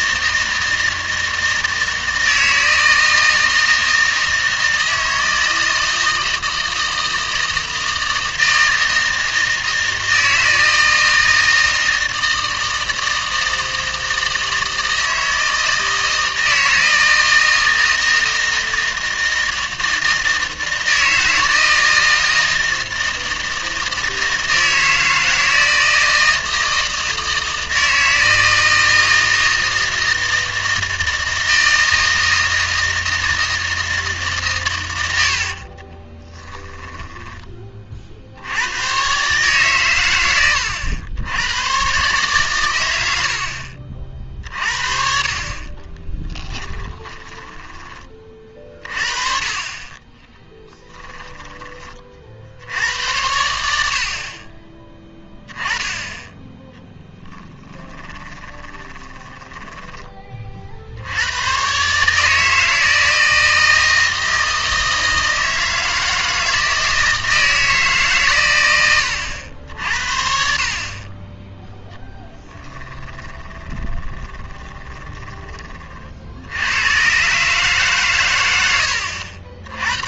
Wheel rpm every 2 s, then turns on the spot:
160, 160, 160, 160, 160, 160, 160, 160, 160, 160, 160, 160, 160, 160, 160, 160, 160, 110, 10, 100, 100, 110, 50, 10, 40, 10, 70, 20, 10, 20, 50, 160, 160, 160, 110, 40, 10, 20, 90, 90.
36-38 46-48 50-52 58-60 72-76